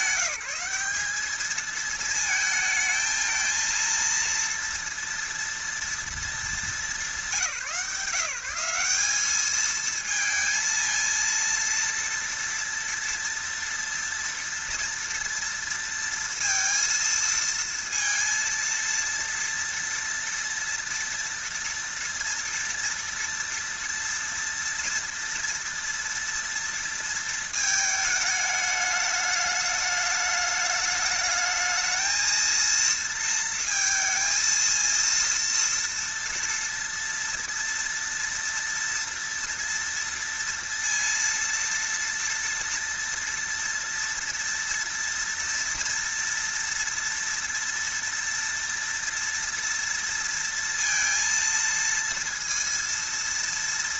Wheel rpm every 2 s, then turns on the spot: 190, 220, 230, 200, 170, 220, 230, 230, 230, 230, 230, 230, 230, 230, 210, 210, 230, 230, 240, 230, 230, 230, 230, 230, 240, 230, 230.
none